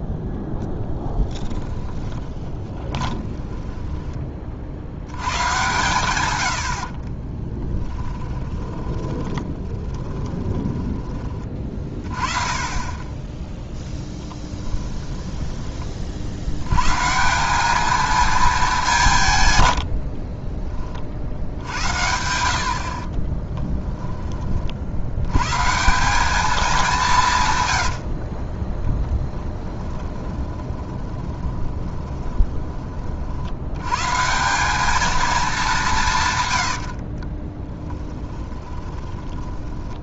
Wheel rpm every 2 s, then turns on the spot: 30, 20, 60, 80, 20, 20, 20, 10, 110, 210, 30, 60, 50, 200, 30, 20, 20, 200, 90, 20.
2-4 8-12 14-16 28-32 36-40